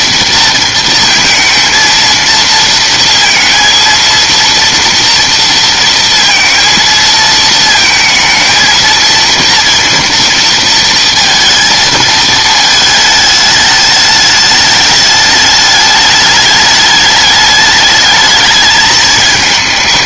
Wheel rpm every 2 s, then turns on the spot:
230, 230, 230, 230, 230, 230, 220, 210, 210, 220.
none